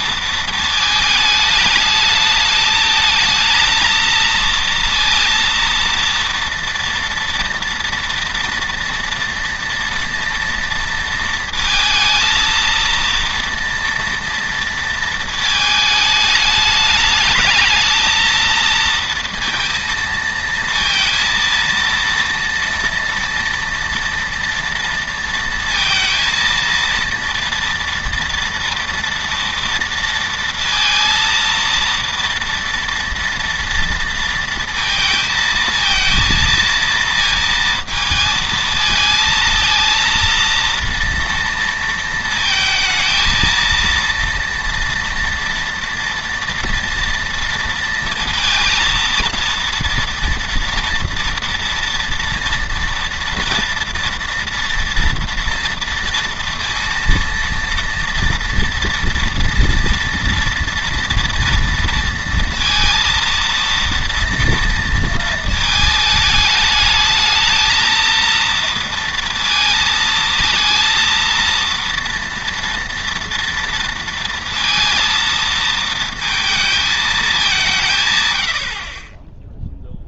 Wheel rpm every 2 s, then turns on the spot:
220, 220, 230, 230, 230, 230, 230, 230, 210, 230, 230, 230, 230, 230, 230, 230, 230, 230, 230, 220, 230, 230, 230, 230, 230, 230, 230, 230, 230, 230, 230, 230, 230, 220, 230, 230, 230, 230, 220, 70.
none